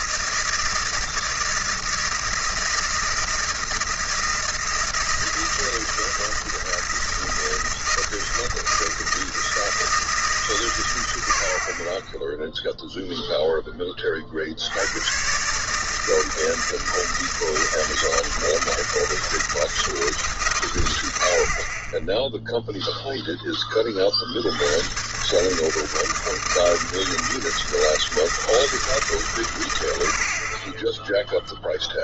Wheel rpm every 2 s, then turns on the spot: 160, 160, 160, 160, 160, 130, 0, 70, 160, 160, 120, 0, 90, 160, 150, 20.
none